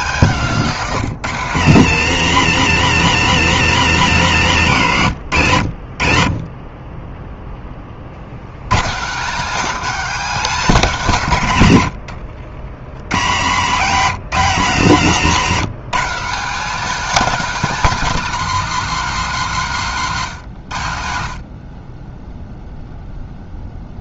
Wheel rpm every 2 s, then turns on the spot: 170, 160, 130, 10, 120, 200, 90, 160, 230, 230, 110, 0.
none